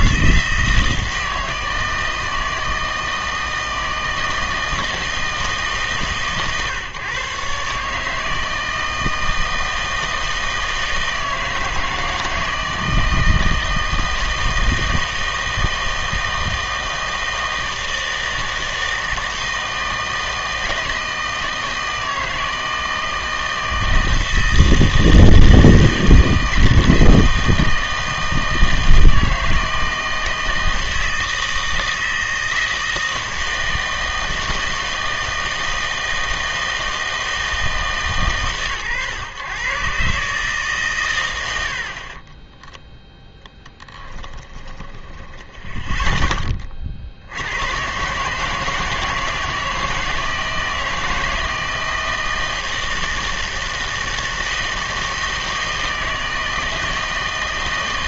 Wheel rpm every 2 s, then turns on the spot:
160, 160, 160, 140, 160, 160, 160, 160, 160, 160, 160, 160, 160, 160, 160, 160, 160, 160, 160, 130, 140, 0, 10, 30, 160, 160, 160, 160, 160.
44-46